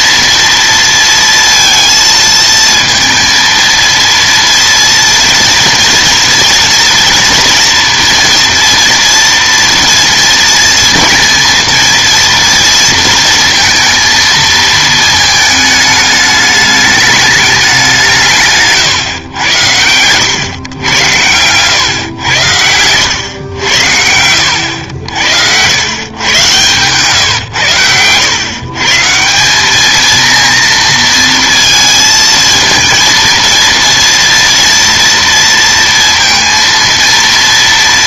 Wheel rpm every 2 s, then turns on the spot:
230, 230, 230, 230, 230, 230, 230, 220, 210, 150, 100, 90, 90, 130, 130, 230, 220, 230, 230.
24-26